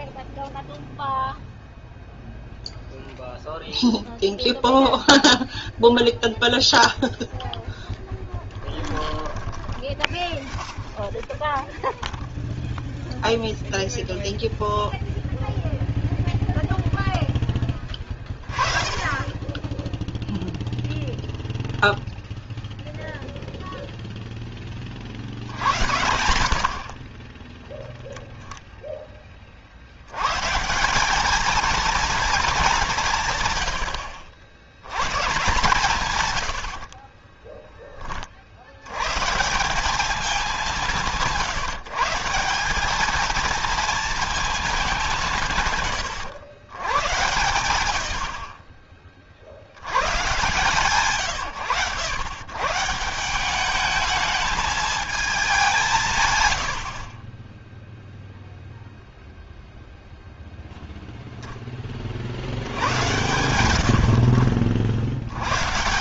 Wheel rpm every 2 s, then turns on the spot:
0, 0, 0, 0, 10, 20, 0, 0, 0, 20, 0, 0, 20, 60, 0, 150, 210, 100, 70, 50, 200, 190, 210, 110, 60, 140, 130, 220, 90, 0, 0, 70, 60.
8-12 36-38